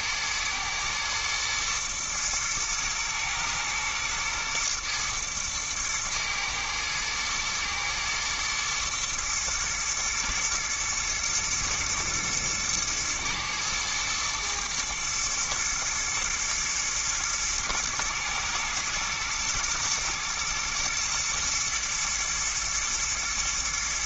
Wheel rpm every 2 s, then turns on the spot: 120, 110, 120, 110, 120, 110, 110, 110, 110, 110, 110, 110.
none